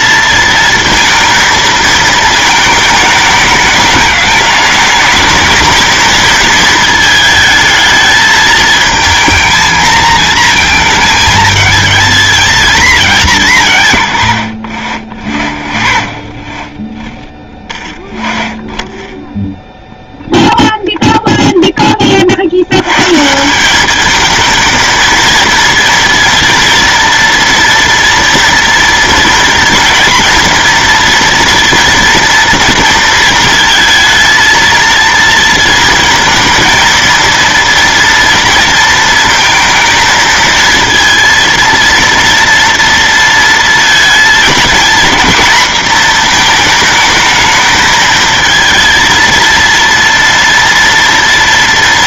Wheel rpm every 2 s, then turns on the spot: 230, 220, 210, 230, 220, 220, 230, 100, 30, 10, 0, 100, 230, 230, 230, 230, 230, 230, 230, 230, 230, 230, 240, 230, 230, 230.
none